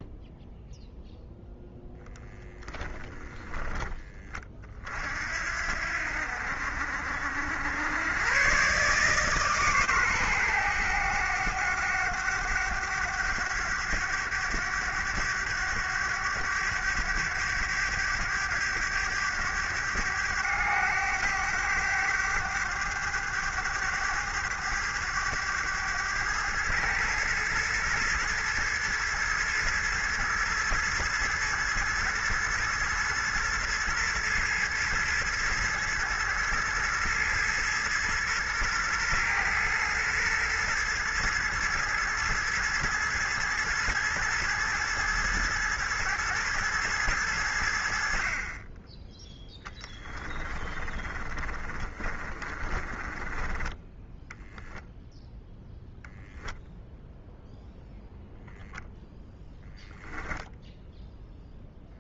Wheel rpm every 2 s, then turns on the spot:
0, 10, 50, 70, 140, 100, 100, 100, 100, 100, 100, 100, 100, 110, 110, 110, 110, 110, 110, 120, 110, 110, 110, 100, 20, 30, 20, 10, 0, 10, 0.
2-4 50-54